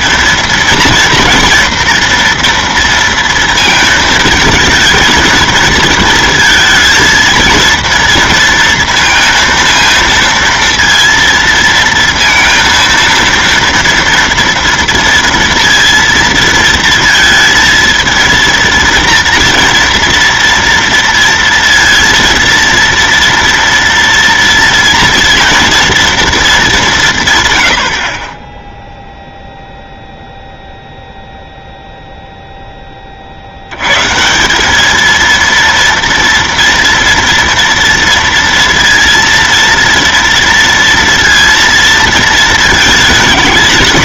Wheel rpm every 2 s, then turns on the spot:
230, 230, 230, 230, 230, 230, 230, 230, 230, 230, 230, 230, 230, 210, 10, 0, 0, 190, 230, 230, 230, 230.
none